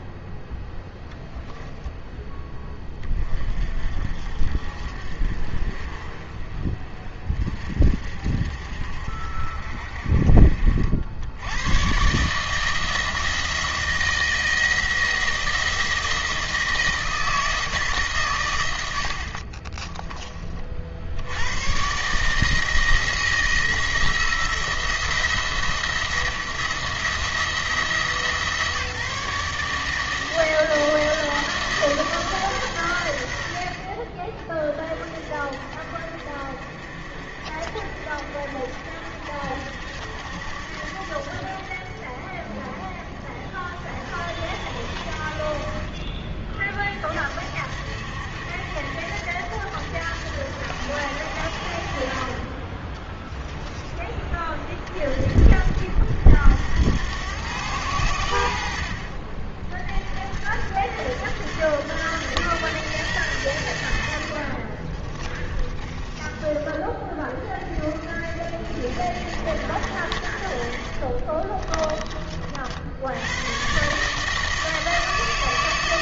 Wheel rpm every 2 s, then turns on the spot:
10, 10, 40, 30, 50, 60, 160, 170, 160, 80, 60, 160, 170, 170, 160, 160, 120, 30, 50, 60, 70, 40, 60, 40, 70, 80, 20, 30, 80, 60, 70, 110, 40, 20, 60, 50, 70, 160.
64-66 70-72